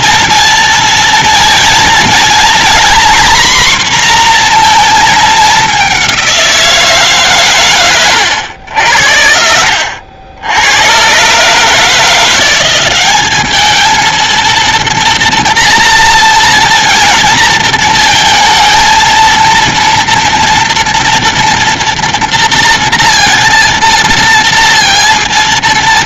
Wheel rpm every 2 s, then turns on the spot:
230, 240, 230, 150, 80, 110, 190, 230, 230, 230, 230, 230, 230.
none